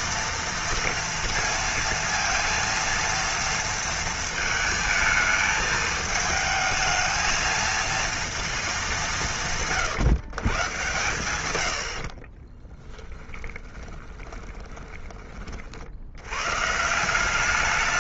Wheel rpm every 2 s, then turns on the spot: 230, 230, 220, 220, 210, 110, 20, 20, 140.
12-16